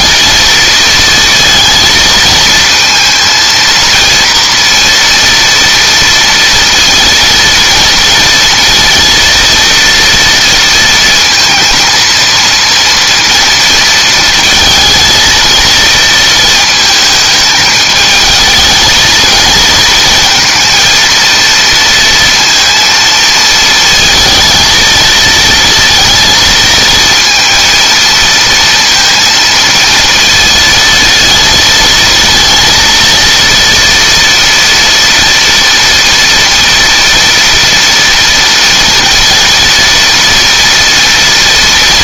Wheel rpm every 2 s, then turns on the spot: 230, 230, 230, 230, 230, 230, 230, 220, 220, 220, 230, 230, 230, 230, 230, 230, 230, 230, 230, 230, 230.
none